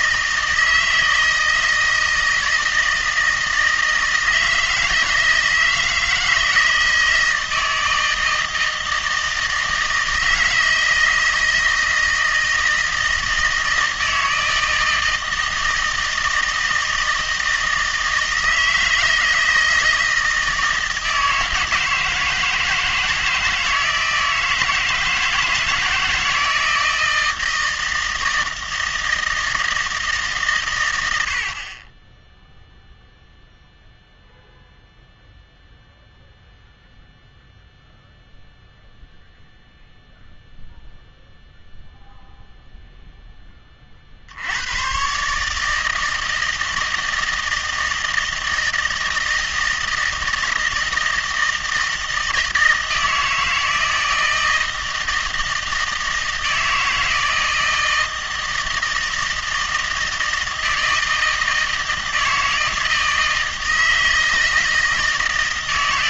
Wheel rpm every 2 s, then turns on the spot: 160, 160, 160, 160, 160, 160, 160, 160, 160, 160, 160, 160, 160, 160, 160, 110, 0, 0, 0, 0, 0, 0, 110, 160, 160, 160, 160, 160, 160, 160, 160, 160, 160.
none